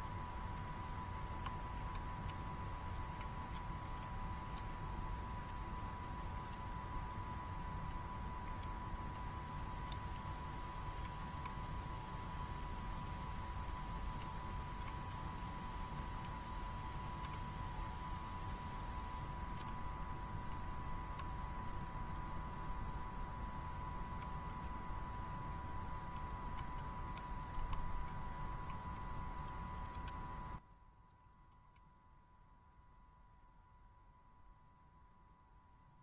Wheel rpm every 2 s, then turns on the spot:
120, 120, 120, 120, 120, 120, 120, 120, 120, 120, 120, 120, 120, 120, 120, 120, 120, 120.
none